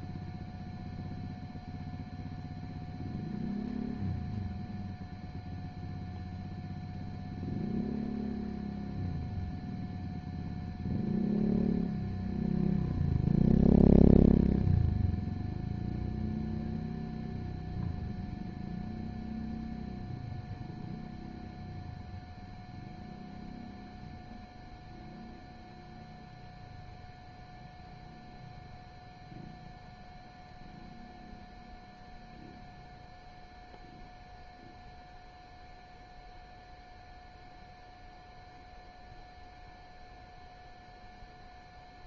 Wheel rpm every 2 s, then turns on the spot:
0, 0, 0, 0, 0, 0, 0, 0, 0, 0, 0, 0, 0, 0, 0, 0, 0, 0, 0, 0, 0.
none